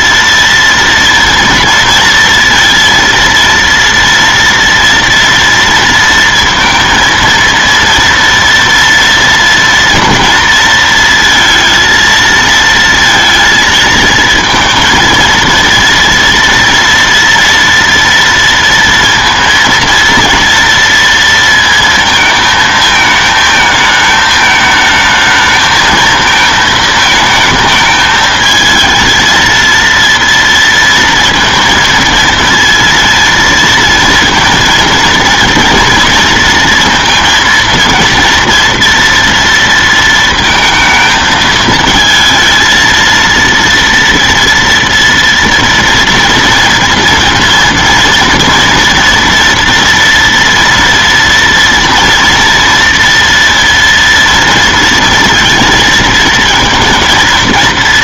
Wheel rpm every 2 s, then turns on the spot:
230, 230, 230, 230, 230, 230, 230, 230, 230, 230, 230, 220, 220, 220, 220, 230, 230, 230, 230, 230, 230, 230, 230, 240, 230, 230, 230, 230, 230.
none